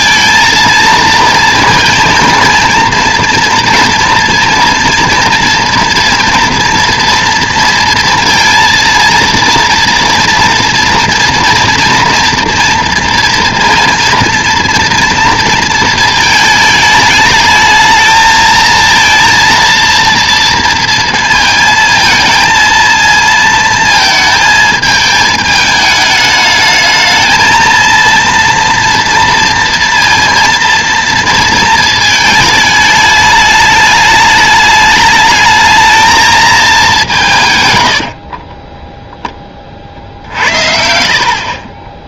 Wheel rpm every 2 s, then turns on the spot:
230, 230, 230, 230, 230, 230, 240, 230, 220, 230, 230, 220, 220, 220, 230, 230, 210, 210, 200, 30, 60.
38-42